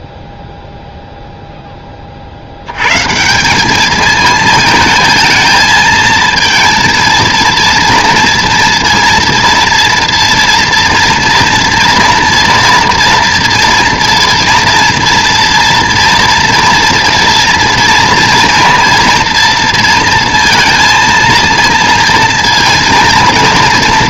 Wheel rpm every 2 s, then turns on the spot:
0, 90, 220, 230, 230, 230, 230, 230, 230, 230, 230, 230.
none